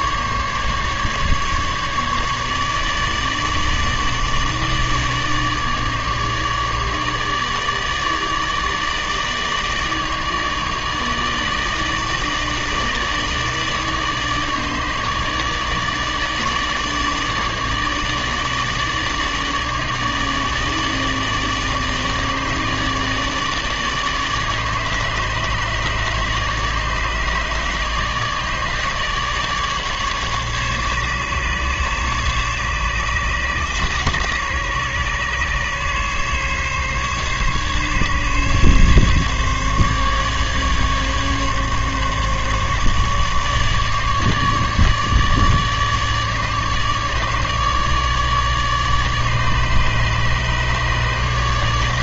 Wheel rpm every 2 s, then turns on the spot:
140, 150, 150, 150, 150, 150, 160, 150, 150, 150, 160, 150, 150, 150, 150, 140, 140, 140, 140, 140, 150, 150, 150, 150, 150, 150.
none